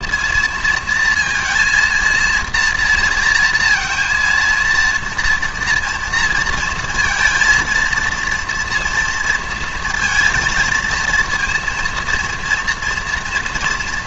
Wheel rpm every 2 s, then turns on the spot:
230, 230, 230, 230, 230, 230, 240.
none